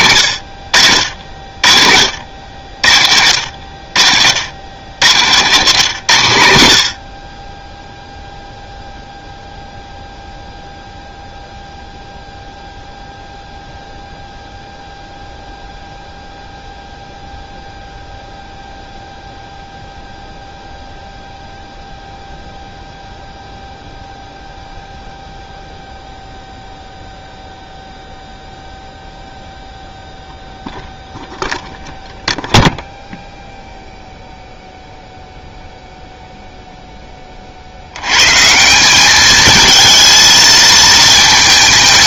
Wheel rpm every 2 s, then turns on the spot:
60, 70, 90, 80, 0, 0, 0, 0, 0, 0, 0, 0, 0, 0, 0, 0, 0, 0, 0, 170, 220.
none